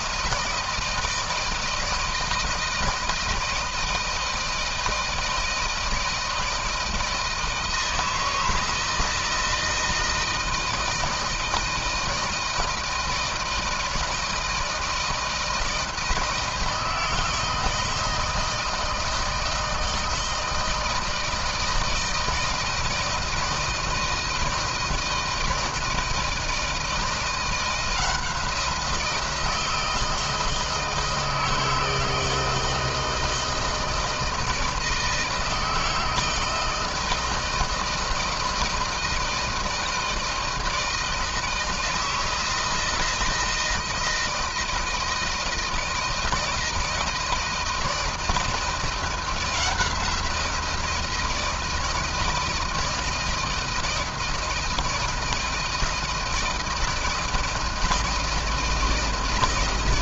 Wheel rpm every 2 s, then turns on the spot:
160, 160, 160, 160, 160, 160, 160, 160, 160, 160, 160, 160, 160, 170, 170, 160, 160, 160, 160, 160, 160, 160, 160, 160, 170, 170, 160, 160, 160, 160.
none